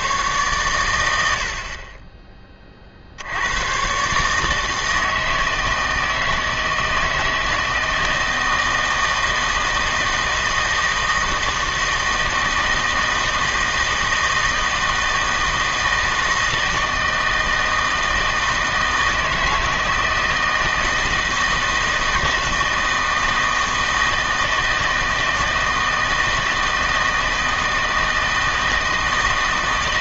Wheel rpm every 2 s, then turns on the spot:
110, 40, 160, 160, 160, 160, 160, 160, 160, 160, 160, 160, 160, 160, 160.
none